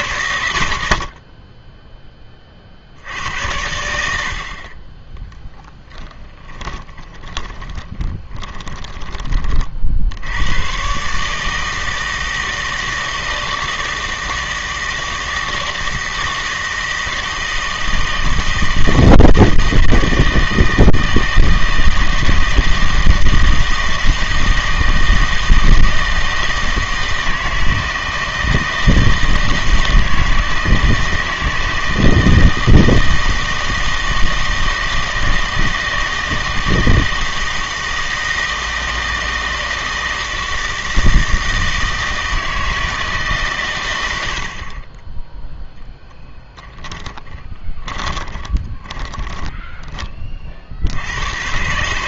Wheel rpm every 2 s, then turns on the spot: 60, 50, 40, 20, 20, 110, 160, 160, 160, 160, 160, 160, 160, 160, 160, 160, 160, 160, 160, 160, 160, 160, 40, 10, 30, 50.
6-10 46-50